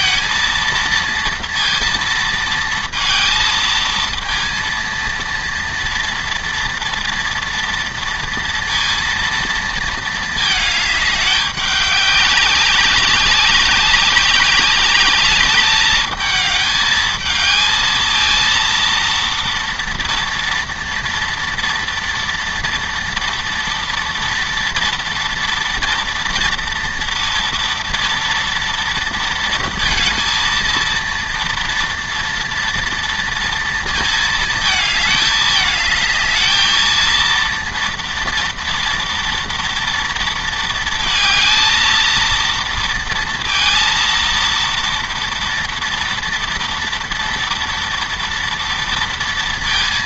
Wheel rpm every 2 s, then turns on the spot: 230, 220, 230, 230, 230, 210, 190, 200, 220, 230, 230, 230, 230, 230, 230, 230, 230, 220, 220, 230, 230, 230, 230, 230, 230.
none